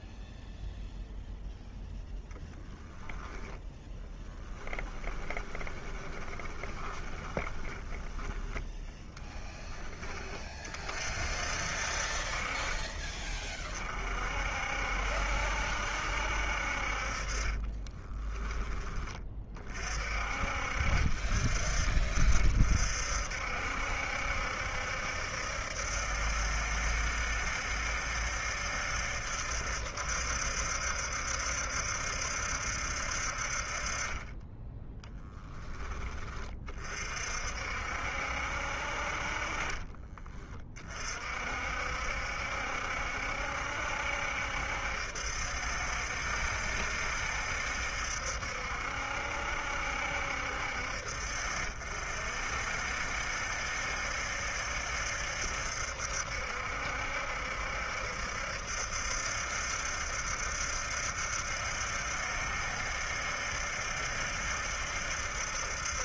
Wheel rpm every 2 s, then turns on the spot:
0, 0, 10, 10, 10, 50, 40, 60, 50, 20, 50, 60, 70, 70, 70, 70, 60, 10, 50, 50, 40, 70, 70, 70, 70, 60, 60, 70, 70, 70, 70, 70, 70.
4-10 16-18 34-36